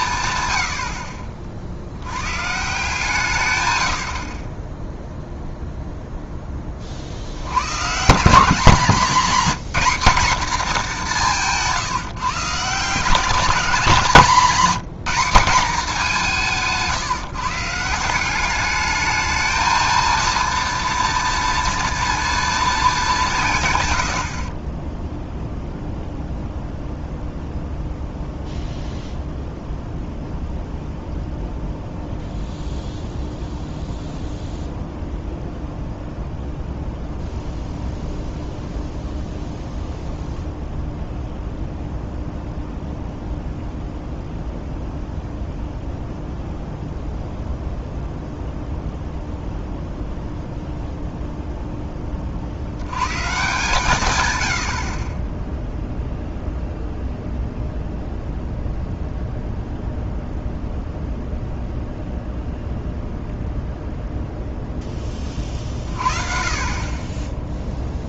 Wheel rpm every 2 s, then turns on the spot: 80, 140, 20, 20, 200, 220, 160, 200, 160, 200, 230, 220, 30, 0, 0, 0, 0, 0, 0, 0, 0, 0, 0, 0, 0, 0, 80, 80, 0, 0, 0, 0, 0, 40.
none